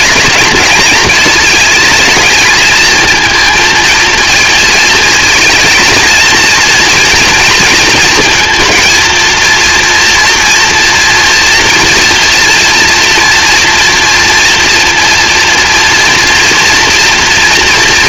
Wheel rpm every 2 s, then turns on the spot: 220, 220, 230, 230, 220, 230, 230, 230, 230.
none